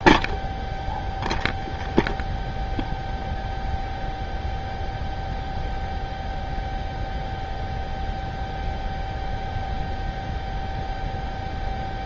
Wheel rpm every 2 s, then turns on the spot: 0, 0, 0, 0, 0, 0.
none